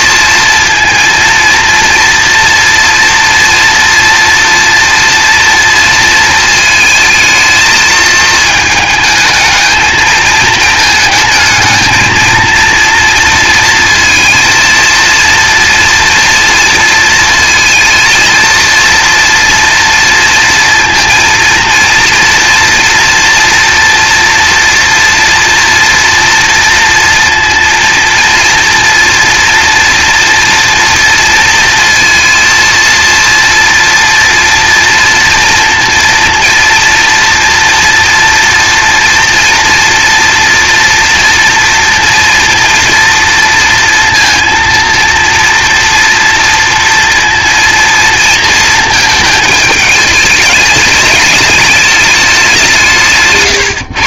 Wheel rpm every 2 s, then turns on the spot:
230, 230, 230, 220, 220, 220, 230, 230, 230, 230, 230, 230, 230, 240, 230, 230, 230, 230, 230, 230, 230, 230, 230, 230, 230, 210, 190.
none